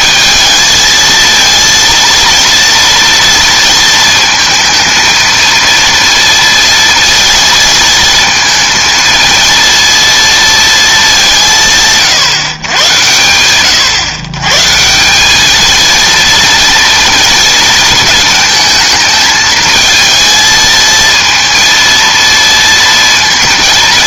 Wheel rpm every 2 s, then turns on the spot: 220, 230, 220, 230, 230, 220, 110, 160, 230, 220, 230, 230.
none